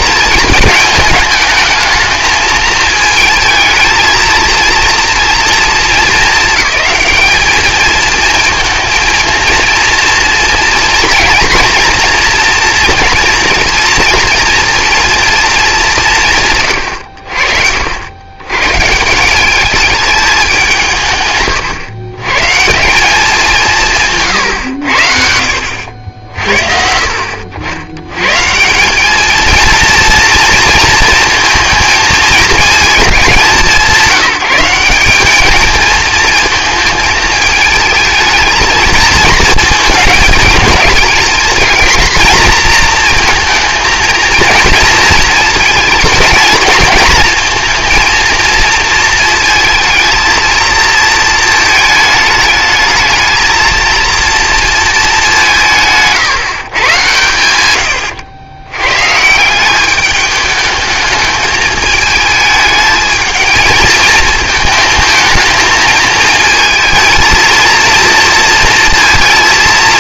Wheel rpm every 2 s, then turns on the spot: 210, 220, 230, 210, 230, 230, 240, 230, 120, 140, 180, 160, 110, 50, 180, 230, 220, 190, 220, 220, 220, 230, 230, 230, 230, 220, 220, 230, 130, 110, 210, 220, 220, 230, 230.
24-26